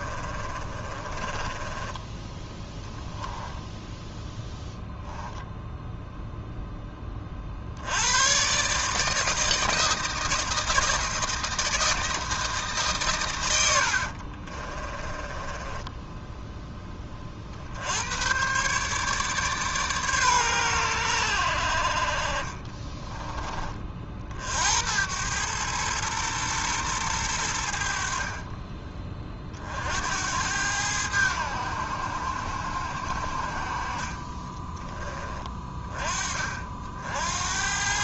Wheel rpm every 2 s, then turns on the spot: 30, 10, 0, 0, 140, 160, 150, 30, 10, 130, 110, 30, 70, 110, 30, 90, 60, 20, 40.
0-2 14-16 22-24 28-30 34-36